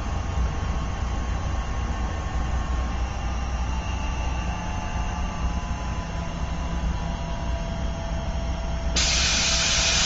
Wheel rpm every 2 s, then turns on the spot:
0, 0, 0, 0, 0.
none